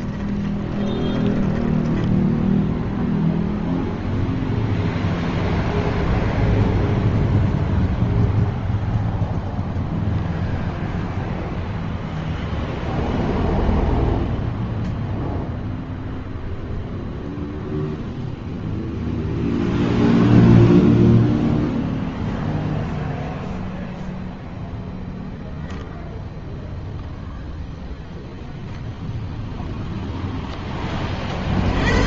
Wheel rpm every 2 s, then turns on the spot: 10, 0, 0, 0, 0, 0, 0, 0, 0, 0, 0, 0, 0, 0, 0, 100.
0-2